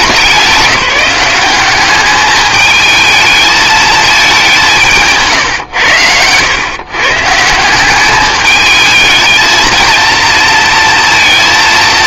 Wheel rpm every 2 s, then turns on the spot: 190, 220, 190, 120, 210, 230.
none